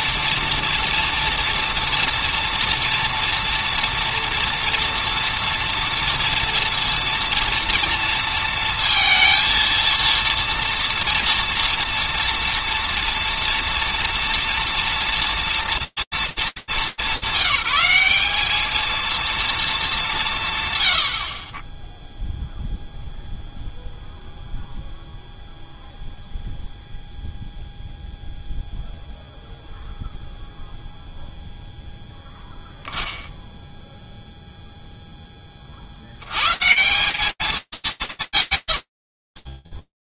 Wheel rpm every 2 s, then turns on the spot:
230, 230, 230, 230, 230, 230, 230, 230, 190, 220, 120, 0, 0, 0, 0, 0, 0, 50, 220, 60.
38-40